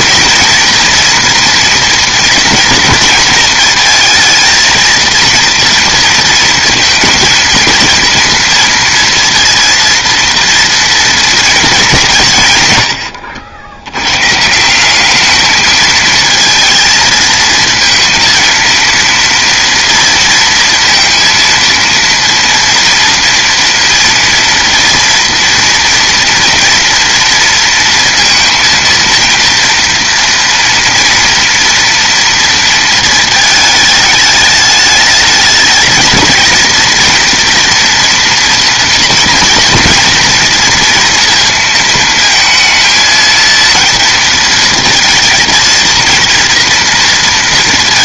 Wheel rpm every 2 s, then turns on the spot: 230, 220, 220, 220, 230, 230, 120, 170, 230, 230, 230, 230, 240, 230, 230, 230, 230, 210, 220, 230, 240, 230, 230, 230.
none